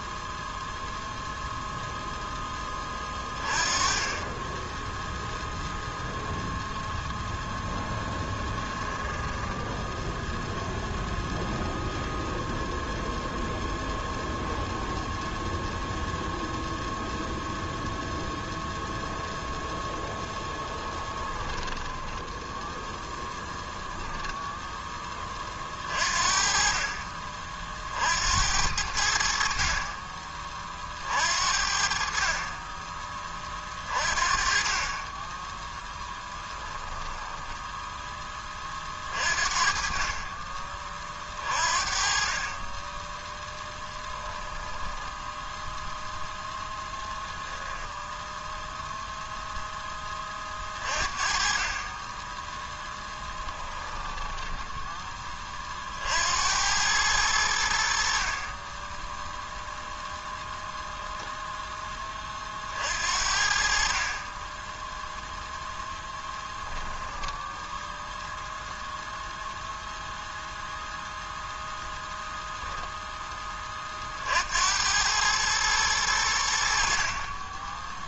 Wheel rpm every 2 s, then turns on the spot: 0, 20, 10, 10, 10, 0, 0, 0, 0, 0, 10, 0, 10, 40, 70, 50, 20, 30, 10, 40, 30, 20, 10, 10, 0, 40, 10, 10, 100, 10, 0, 60, 10, 10, 0, 0, 0, 100, 50.
8-10 20-22 36-38 46-48 52-54 58-60 64-66